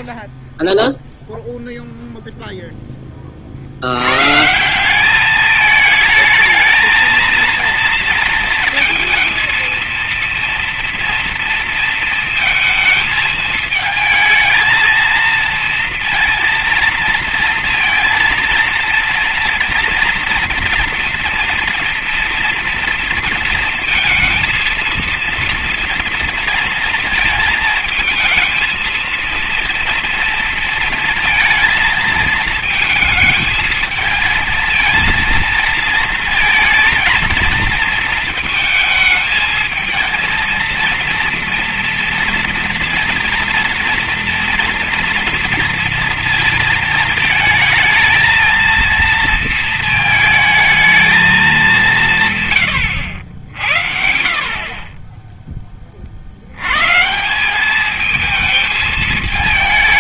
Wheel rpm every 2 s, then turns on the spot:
0, 10, 180, 230, 230, 230, 220, 230, 230, 230, 230, 230, 230, 230, 230, 230, 220, 220, 230, 220, 230, 230, 230, 220, 230, 220, 120, 20, 130, 220.
none